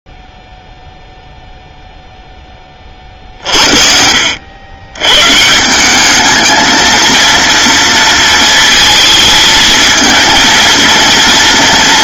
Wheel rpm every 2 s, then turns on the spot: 0, 20, 90, 220, 230, 230.
none